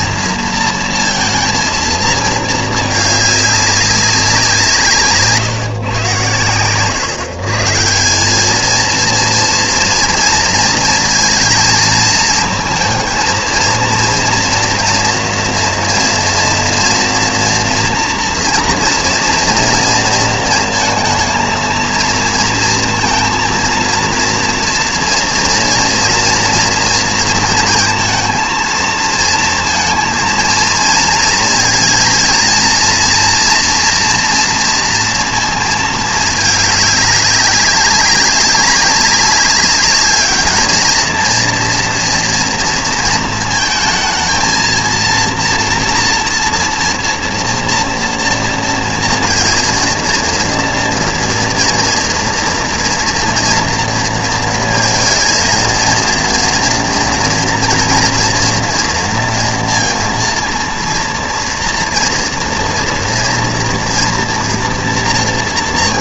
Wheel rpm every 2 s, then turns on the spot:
230, 220, 170, 110, 210, 230, 230, 230, 230, 230, 230, 230, 230, 230, 220, 230, 230, 230, 210, 190, 210, 230, 220, 230, 230, 230, 230, 230, 230, 230, 230, 240, 230.
none